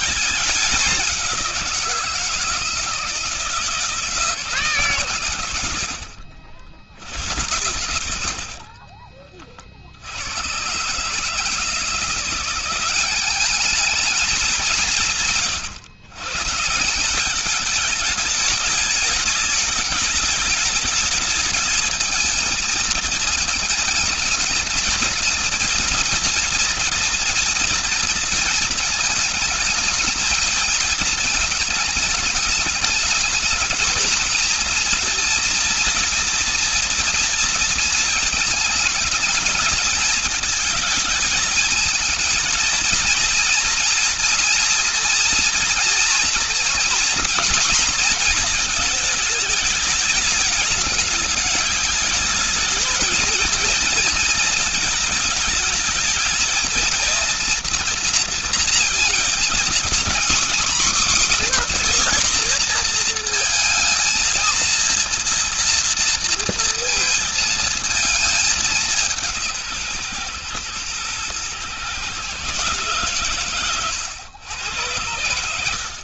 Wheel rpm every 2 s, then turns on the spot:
200, 160, 150, 90, 40, 120, 180, 170, 170, 220, 210, 220, 220, 230, 230, 220, 220, 230, 230, 220, 220, 230, 240, 240, 230, 220, 220, 230, 230, 230, 270, 240, 230, 230, 190, 120, 140, 100.
8-10